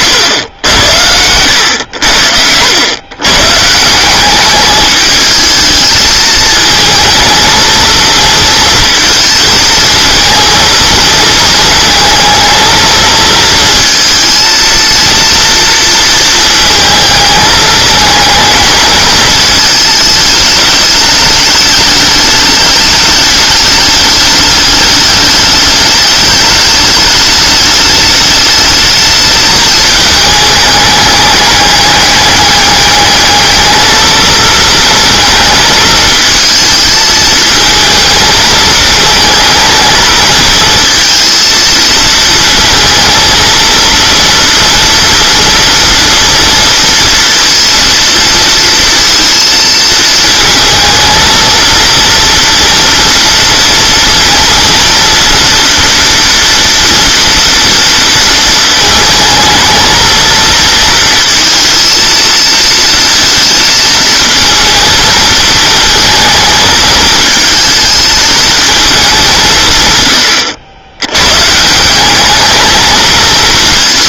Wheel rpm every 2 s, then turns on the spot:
90, 100, 200, 220, 230, 230, 220, 230, 220, 220, 210, 210, 210, 210, 210, 210, 210, 230, 220, 220, 220, 230, 230, 240, 230, 230, 230, 230, 230, 220, 230, 230, 220, 220, 210, 90, 220.
none